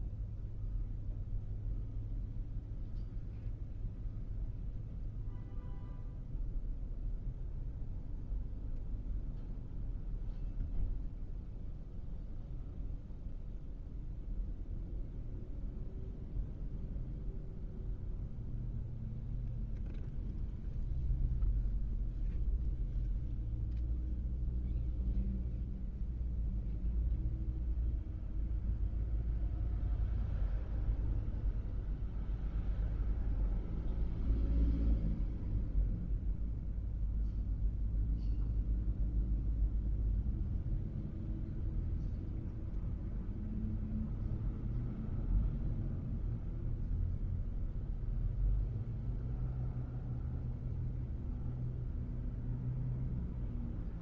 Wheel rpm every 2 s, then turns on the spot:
0, 0, 0, 0, 0, 0, 0, 0, 0, 0, 0, 0, 0, 0, 0, 0, 0, 0, 0, 0, 0, 0, 0, 0, 0, 0, 0.
none